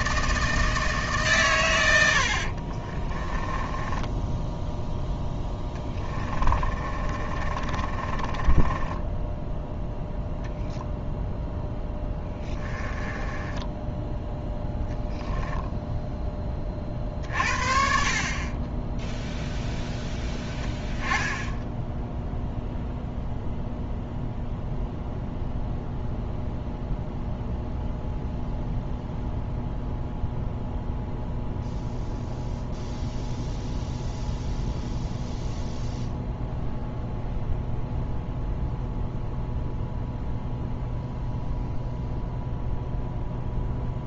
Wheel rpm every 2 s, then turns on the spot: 160, 30, 0, 30, 20, 0, 20, 0, 40, 10, 10, 0, 0, 0, 0, 0, 0, 0, 0, 0, 0, 0.
2-4 6-10 12-14